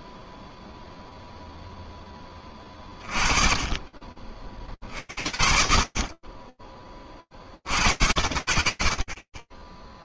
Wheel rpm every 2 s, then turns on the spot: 0, 30, 50, 30, 60.
none